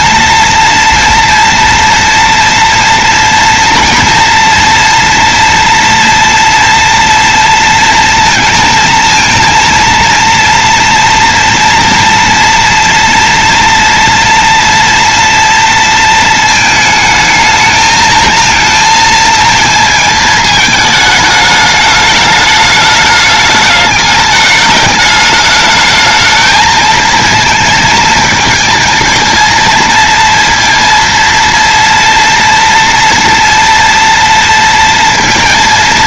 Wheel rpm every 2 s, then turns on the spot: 230, 230, 230, 230, 230, 230, 240, 230, 220, 220, 220, 210, 210, 220, 230, 230, 230, 230.
none